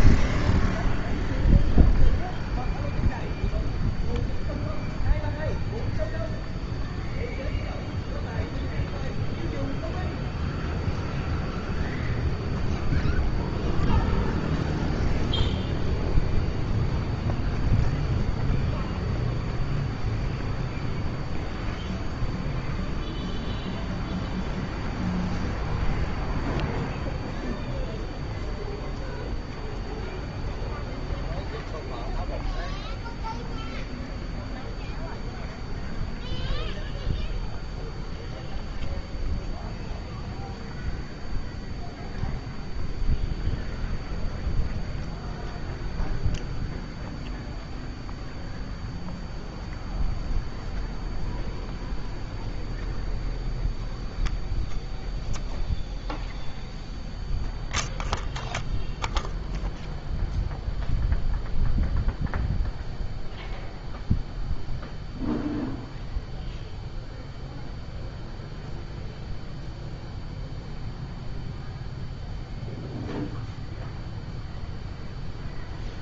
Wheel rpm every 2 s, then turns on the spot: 0, 0, 0, 0, 0, 0, 0, 0, 0, 0, 0, 0, 0, 0, 0, 0, 0, 0, 0, 0, 0, 0, 0, 0, 0, 0, 0, 0, 0, 0, 0, 0, 0, 0, 0, 0, 0, 0.
none